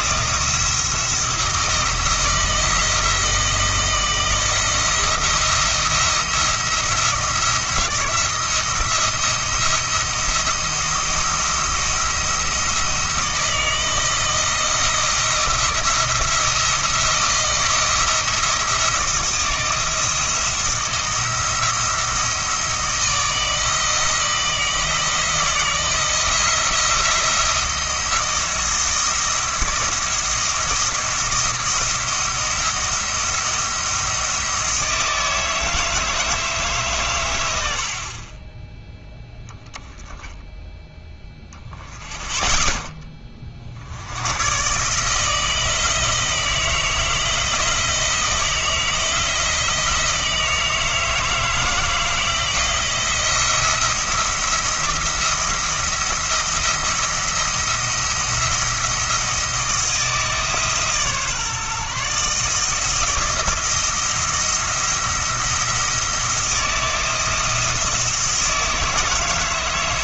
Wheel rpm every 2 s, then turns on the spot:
170, 170, 170, 170, 170, 170, 170, 160, 170, 170, 170, 160, 160, 170, 160, 170, 170, 160, 150, 10, 10, 10, 130, 160, 160, 160, 160, 170, 170, 170, 150, 160, 170, 160, 160.
none